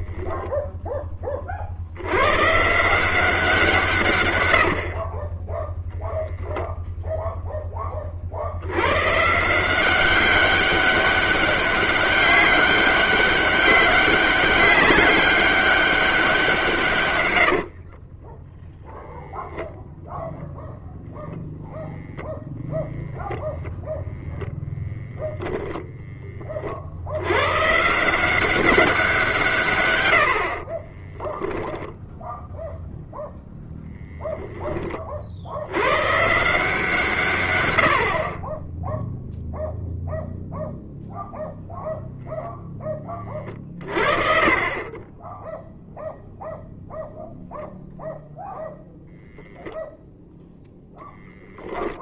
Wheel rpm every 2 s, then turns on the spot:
110, 110, 0, 30, 190, 200, 200, 190, 20, 10, 0, 0, 10, 150, 120, 0, 0, 70, 110, 0, 0, 30, 10, 0, 0, 0.
16-18